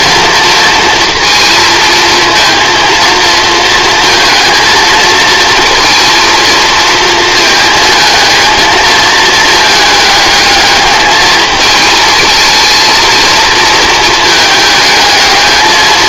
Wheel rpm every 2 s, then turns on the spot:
230, 230, 230, 230, 220, 220, 220, 220.
none